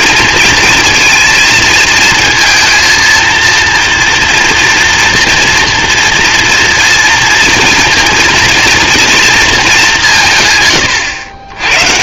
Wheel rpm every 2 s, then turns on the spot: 230, 230, 230, 230, 230, 120.
none